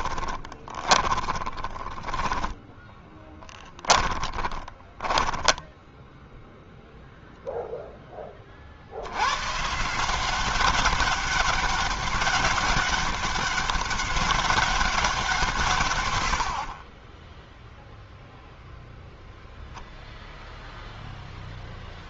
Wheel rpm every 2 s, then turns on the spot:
20, 20, 10, 0, 80, 200, 200, 180, 30, 0, 10.
0-6